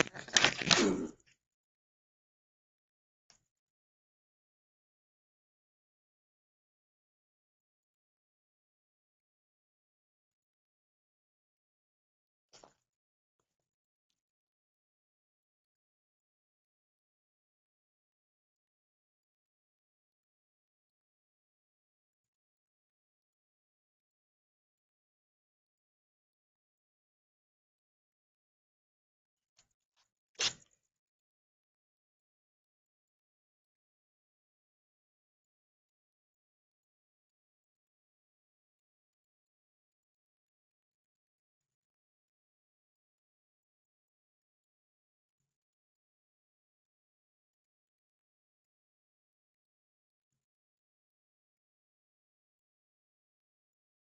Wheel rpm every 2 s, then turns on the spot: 0, 0, 0, 0, 0, 0, 0, 0, 0, 0, 0, 0, 0, 0, 0, 0, 0, 0, 0, 0, 0, 0, 0, 0, 0, 0, 0.
none